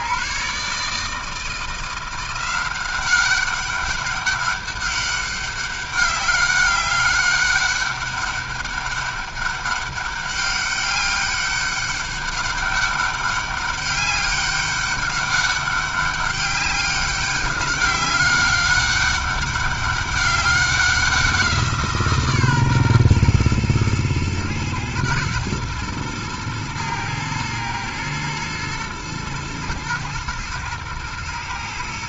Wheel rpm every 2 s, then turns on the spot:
150, 180, 200, 200, 200, 200, 200, 200, 200, 200, 200, 140, 110, 110, 110, 110.
none